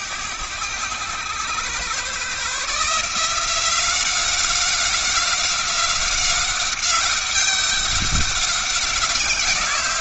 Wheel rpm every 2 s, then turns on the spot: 110, 160, 190, 190, 180.
none